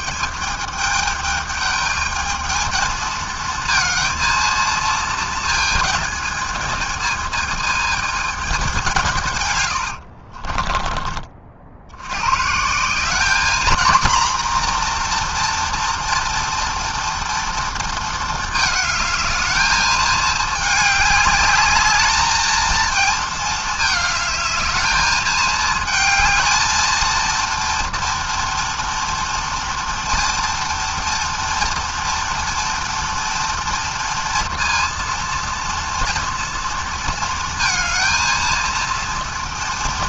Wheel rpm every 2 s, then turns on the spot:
210, 230, 220, 220, 120, 40, 220, 240, 230, 220, 210, 220, 220, 230, 230, 230, 230, 230, 230, 230.
none